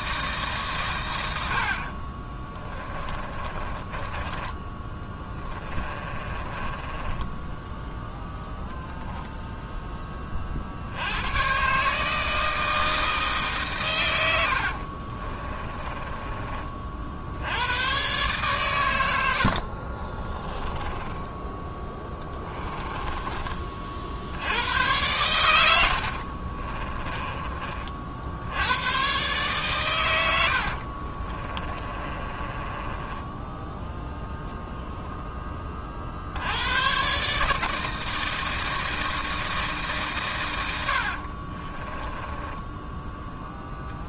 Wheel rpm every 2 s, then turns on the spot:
140, 20, 20, 20, 0, 60, 160, 70, 30, 120, 20, 20, 90, 30, 100, 70, 20, 10, 100, 160, 100, 10.
2-8 14-16 20-24 26-28 30-36 42-44